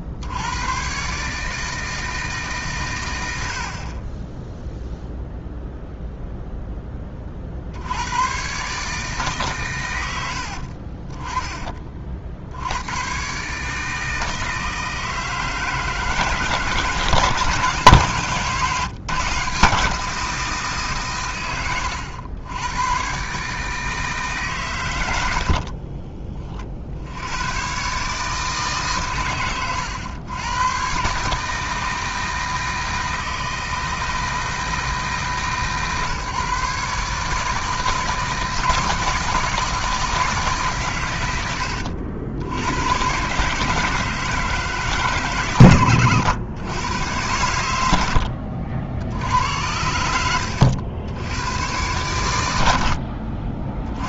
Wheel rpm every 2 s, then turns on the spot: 130, 110, 0, 20, 150, 30, 110, 160, 160, 150, 140, 110, 90, 70, 130, 130, 160, 160, 140, 160, 120, 120, 130, 110, 70, 90, 70.
10-12